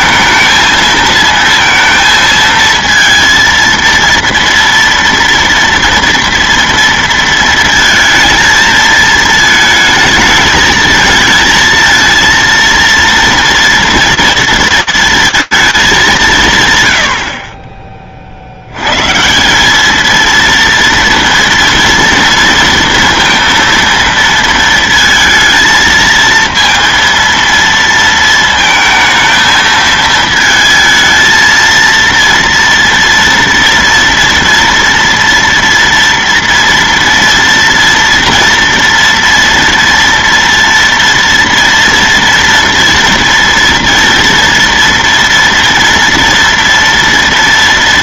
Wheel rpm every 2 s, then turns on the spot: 220, 230, 230, 230, 230, 220, 230, 230, 130, 110, 230, 230, 230, 230, 220, 220, 230, 230, 230, 230, 230, 230, 230, 230.
none